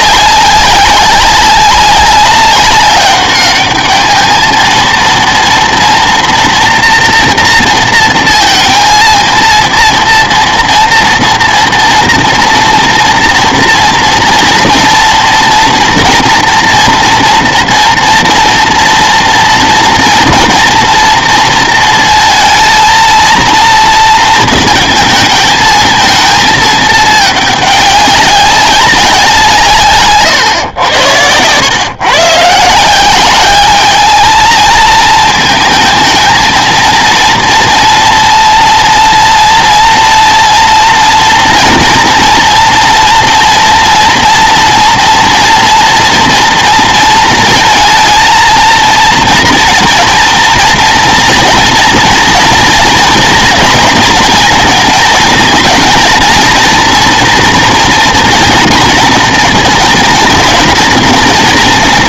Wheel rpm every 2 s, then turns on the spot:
190, 200, 230, 240, 230, 230, 230, 240, 230, 240, 230, 230, 230, 220, 190, 100, 170, 220, 230, 230, 240, 230, 240, 230, 230, 230, 230, 230, 240, 230, 230.
none